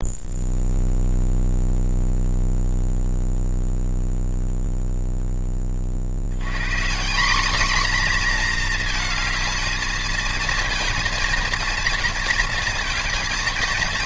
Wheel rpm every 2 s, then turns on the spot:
0, 0, 0, 180, 230, 230, 230.
none